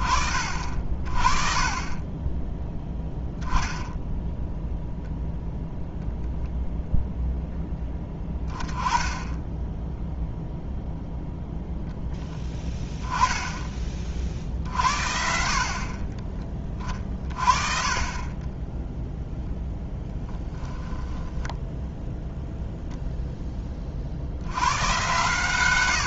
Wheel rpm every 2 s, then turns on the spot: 30, 10, 0, 0, 10, 0, 10, 60, 30, 0, 10, 0, 110.
20-22